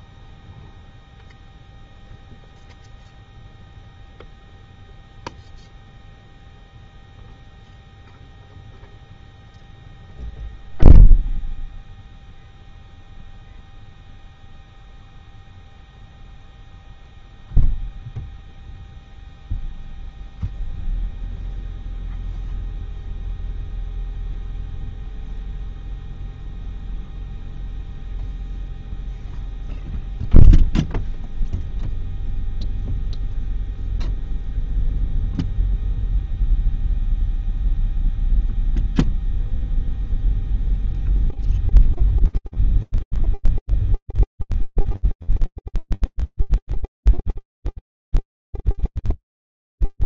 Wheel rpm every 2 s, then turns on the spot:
0, 0, 0, 0, 0, 0, 0, 0, 0, 0, 0, 0, 0, 0, 0, 0, 0, 0, 0, 0, 0, 0, 0, 0, 0.
none